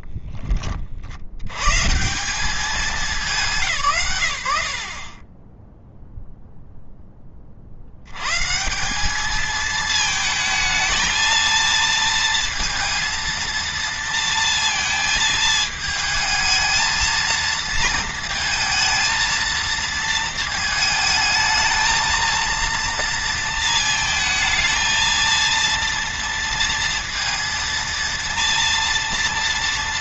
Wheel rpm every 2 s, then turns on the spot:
40, 210, 80, 0, 170, 220, 230, 230, 220, 230, 220, 230, 230, 230, 230.
none